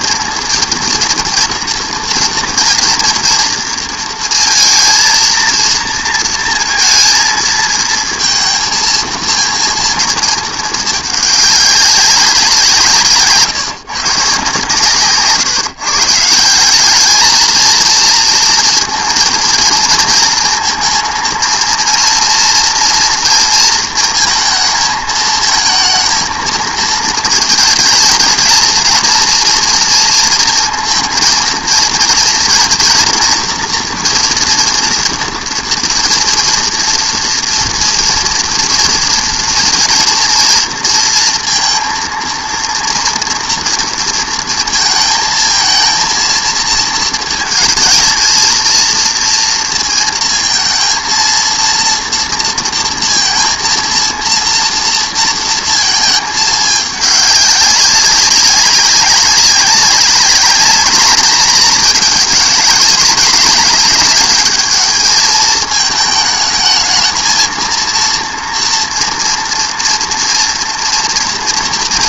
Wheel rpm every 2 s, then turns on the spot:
230, 230, 230, 230, 230, 220, 180, 140, 170, 230, 230, 230, 230, 230, 230, 230, 230, 240, 230, 240, 230, 230, 230, 230, 230, 230, 230, 230, 210, 200, 210, 200, 210, 220, 230, 230.
none